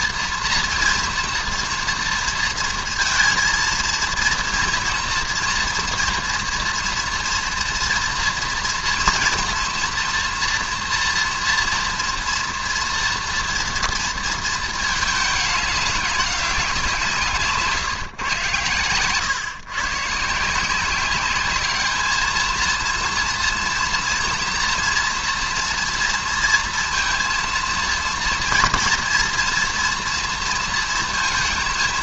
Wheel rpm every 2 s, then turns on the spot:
230, 230, 230, 230, 230, 240, 230, 220, 190, 120, 160, 220, 230, 230, 230, 230.
none